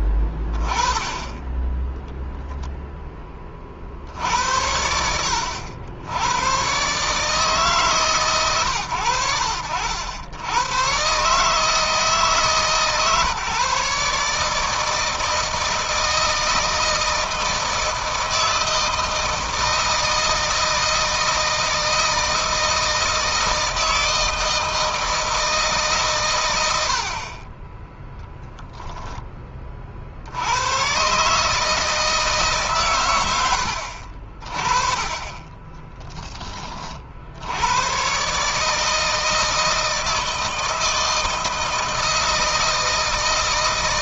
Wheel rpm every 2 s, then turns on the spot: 20, 0, 90, 120, 120, 110, 150, 160, 160, 160, 160, 160, 160, 90, 20, 110, 130, 30, 30, 150, 160, 160.
none